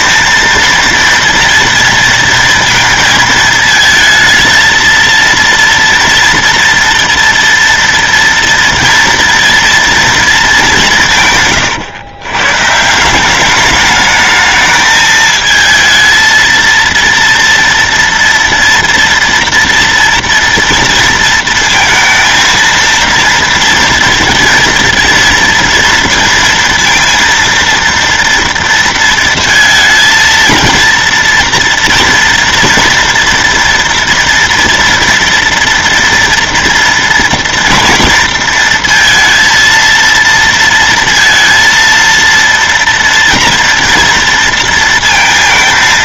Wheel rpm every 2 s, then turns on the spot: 230, 230, 230, 230, 230, 180, 150, 220, 230, 240, 230, 230, 230, 230, 230, 230, 230, 230, 230, 230, 230, 230, 230.
none